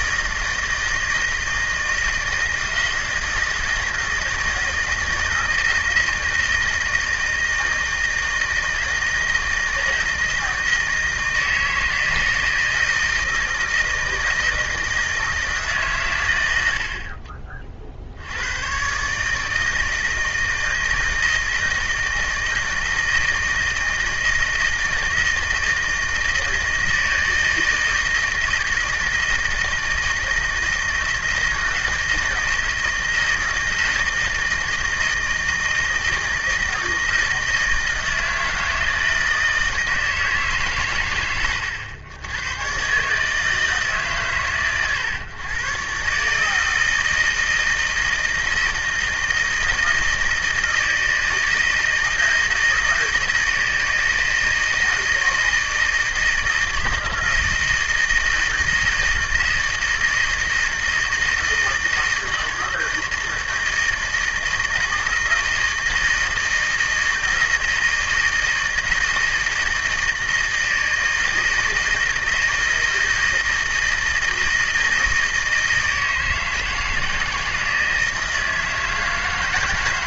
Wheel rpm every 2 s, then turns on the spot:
160, 160, 160, 160, 160, 160, 160, 160, 120, 70, 160, 160, 160, 160, 160, 160, 170, 160, 160, 160, 160, 100, 120, 130, 160, 160, 160, 160, 170, 160, 160, 160, 160, 160, 160, 160, 160, 160, 160, 160.
none